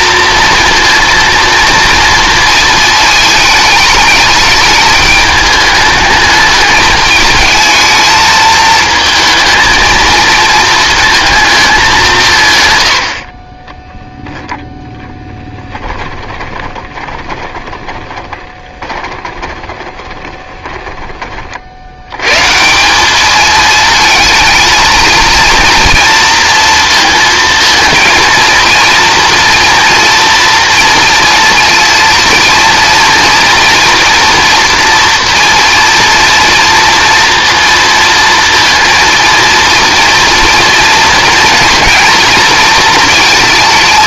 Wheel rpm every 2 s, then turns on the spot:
230, 230, 210, 210, 230, 220, 120, 0, 20, 20, 10, 160, 230, 230, 230, 230, 230, 240, 230, 230, 230, 230.
16-22